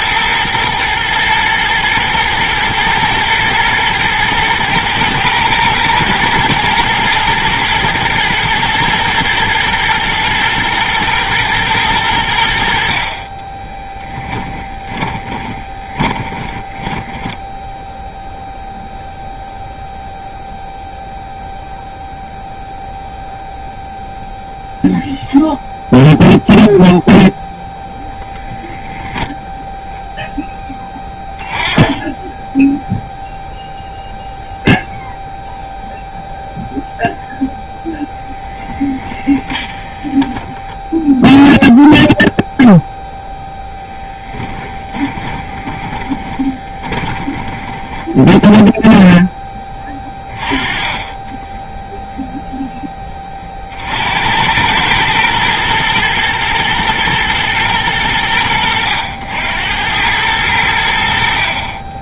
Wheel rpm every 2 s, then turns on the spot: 120, 110, 120, 120, 120, 110, 50, 20, 10, 0, 0, 0, 0, 0, 0, 10, 0, 0, 0, 20, 20, 0, 10, 30, 10, 20, 10, 100, 120, 90, 80.
14-18 38-40 44-50